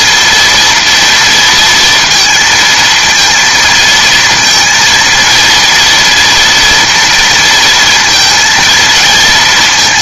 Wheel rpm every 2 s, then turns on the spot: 230, 230, 230, 230, 220.
none